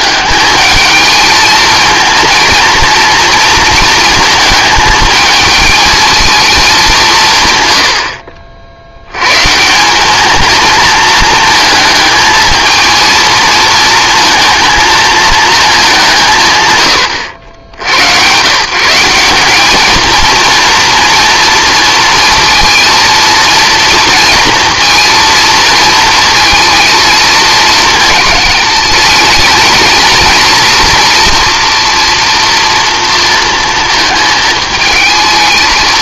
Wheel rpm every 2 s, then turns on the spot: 220, 230, 220, 210, 60, 220, 230, 230, 120, 140, 230, 230, 230, 220, 210, 230, 230, 220.
none